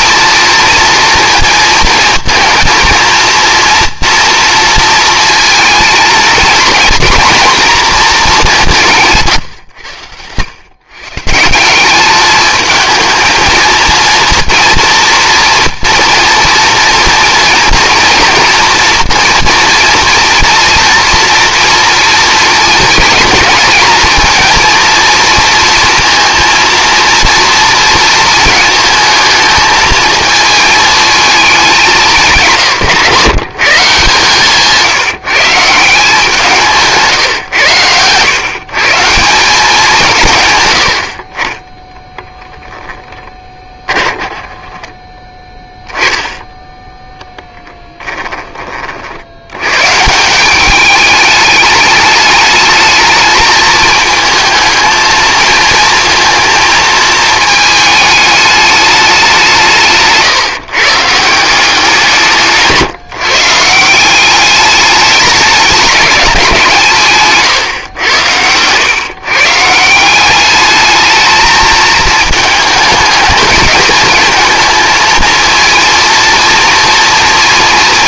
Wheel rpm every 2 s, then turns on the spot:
230, 230, 230, 230, 190, 120, 220, 230, 230, 230, 240, 230, 230, 230, 220, 220, 150, 160, 160, 140, 100, 0, 10, 10, 30, 190, 220, 220, 230, 210, 140, 150, 200, 180, 110, 200, 220, 220, 230.
34-36